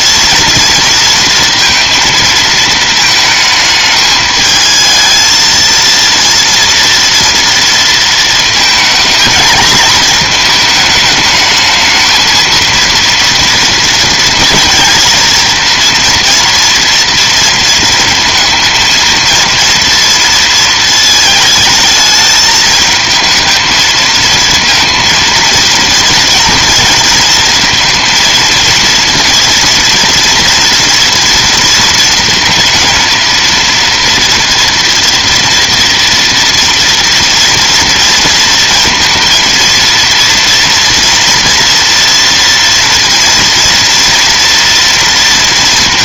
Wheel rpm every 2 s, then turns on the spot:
230, 220, 220, 230, 230, 220, 230, 230, 240, 230, 230, 220, 230, 230, 230, 230, 230, 230, 230, 230, 230, 230, 230.
none